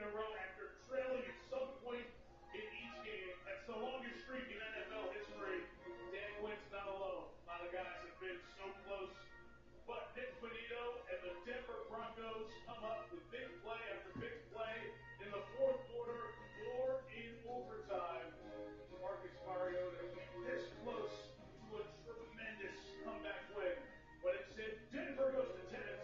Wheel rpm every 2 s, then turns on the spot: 0, 0, 0, 0, 0, 0, 0, 0, 0, 0, 0, 0, 0.
none